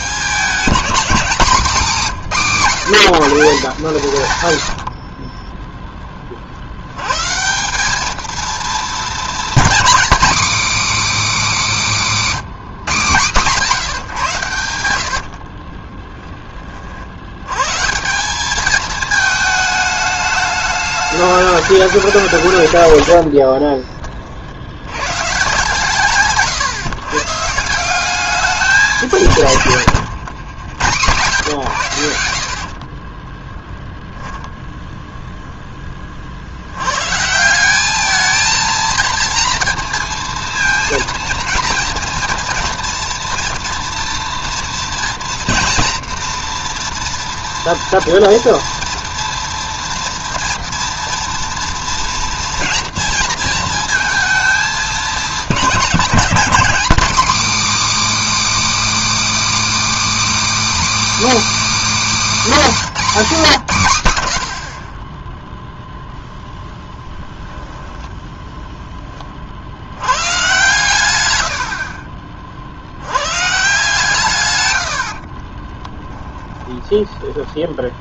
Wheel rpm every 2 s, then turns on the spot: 210, 170, 110, 70, 220, 280, 180, 90, 30, 200, 210, 130, 60, 140, 200, 110, 70, 0, 80, 220, 230, 240, 230, 230, 230, 230, 230, 220, 240, 320, 320, 260, 50, 10, 10, 130, 60, 110, 10.
4-6 14-16 76-78